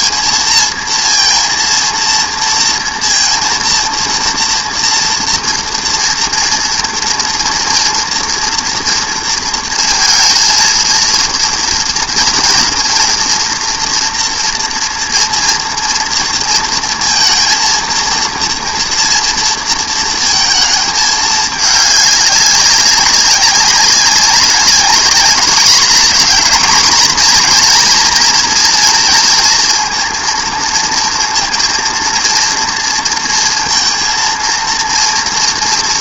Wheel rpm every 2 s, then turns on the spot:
230, 230, 240, 230, 230, 230, 230, 240, 230, 230, 230, 200, 200, 230, 230, 230, 230, 230.
none